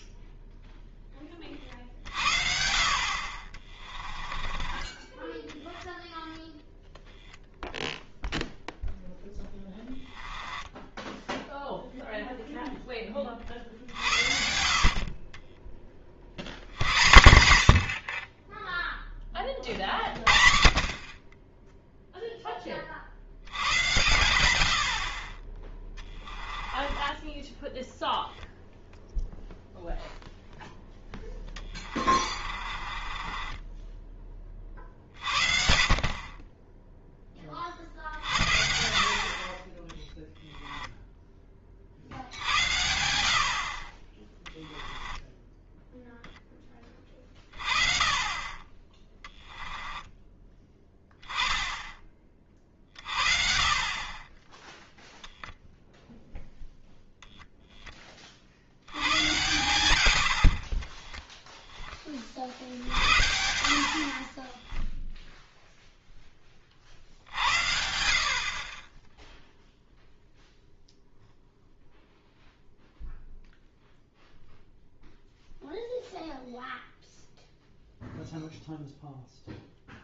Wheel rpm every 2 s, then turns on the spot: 0, 50, 20, 10, 0, 10, 10, 50, 100, 10, 50, 30, 90, 10, 0, 0, 30, 50, 10, 70, 10, 80, 10, 20, 20, 10, 50, 0, 0, 80, 40, 60, 0, 50, 20, 0, 0, 0, 0, 0.
4-6 10-12 26-28 32-34 44-46